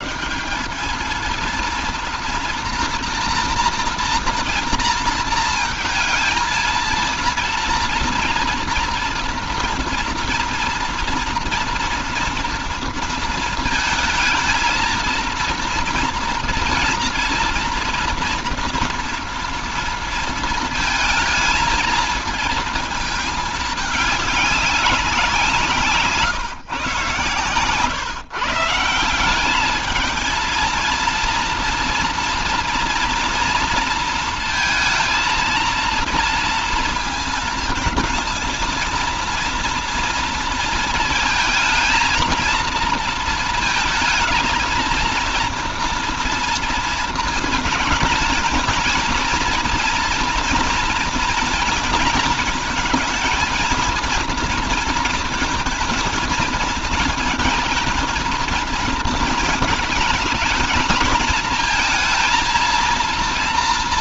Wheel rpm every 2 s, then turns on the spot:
190, 240, 230, 230, 230, 230, 230, 230, 230, 230, 230, 230, 210, 130, 150, 230, 230, 230, 230, 230, 230, 230, 230, 230, 230, 230, 220, 230, 220, 230, 220, 230.
none